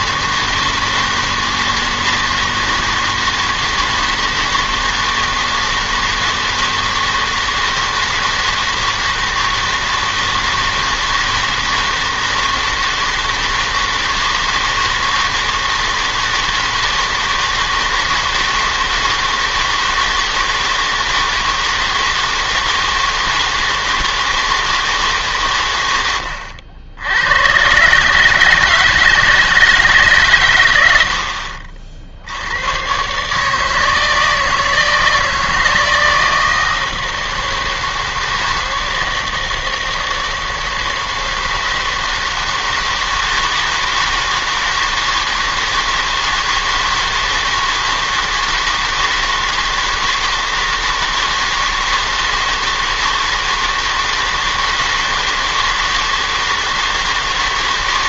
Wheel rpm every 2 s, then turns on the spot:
160, 160, 160, 160, 160, 160, 160, 160, 160, 160, 160, 160, 160, 90, 150, 90, 110, 160, 160, 160, 160, 160, 160, 160, 160, 160, 160, 160, 160.
none